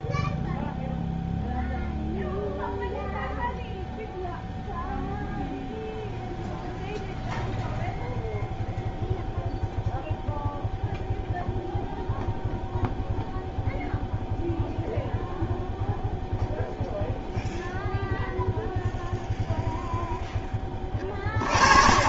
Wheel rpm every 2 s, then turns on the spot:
0, 0, 0, 0, 0, 0, 0, 0, 0, 0, 30.
none